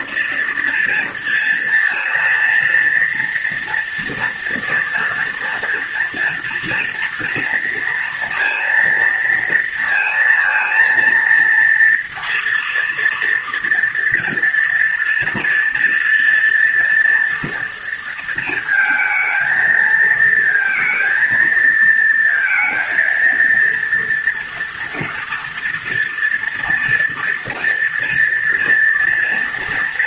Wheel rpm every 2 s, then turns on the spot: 230, 230, 230, 230, 230, 230, 230, 230, 230, 230, 220, 230, 230, 230, 230.
none